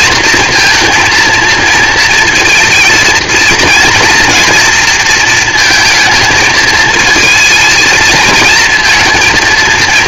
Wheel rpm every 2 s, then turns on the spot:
230, 220, 230, 220, 230.
none